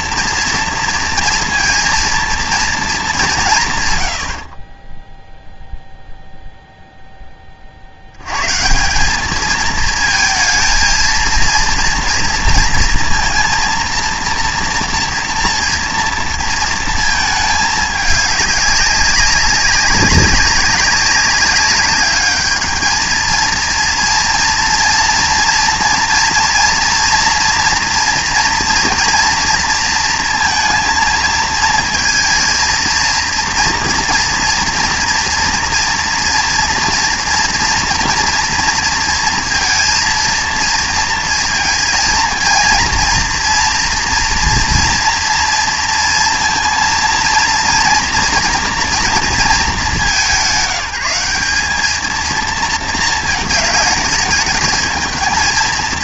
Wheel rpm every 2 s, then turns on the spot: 230, 220, 30, 0, 160, 220, 230, 230, 230, 200, 190, 220, 230, 230, 230, 230, 230, 230, 230, 230, 230, 230, 230, 230, 230, 180, 230, 220.
4-6